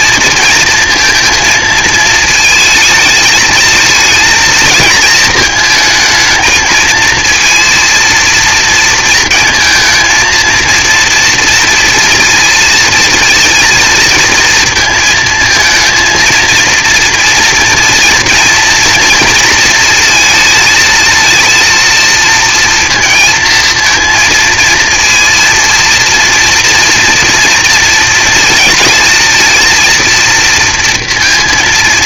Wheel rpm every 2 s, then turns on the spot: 230, 220, 230, 220, 230, 230, 230, 230, 230, 230, 220, 230, 230, 230, 230, 230.
none